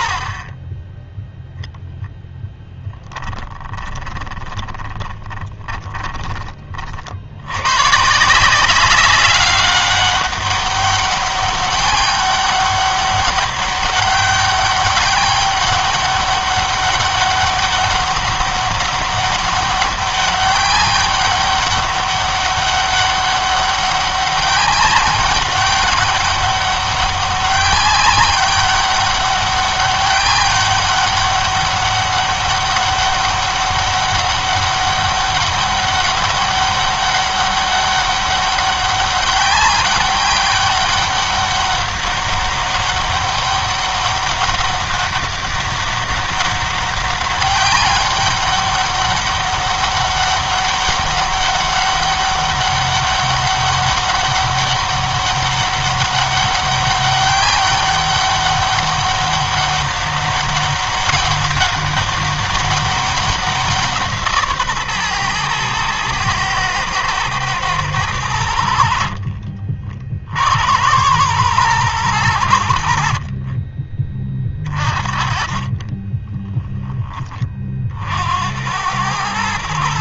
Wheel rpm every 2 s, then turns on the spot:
10, 10, 20, 40, 180, 200, 200, 200, 200, 200, 200, 200, 200, 200, 190, 200, 200, 200, 200, 200, 200, 200, 200, 200, 200, 200, 200, 200, 200, 200, 200, 200, 140, 110, 70, 80, 80, 40, 20, 100.
4-6